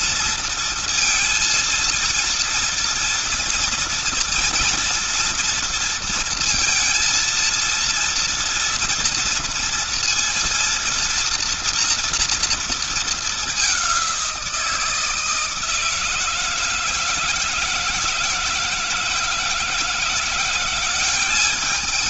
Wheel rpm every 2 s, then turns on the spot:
230, 230, 240, 230, 230, 230, 220, 160, 160, 170, 180.
none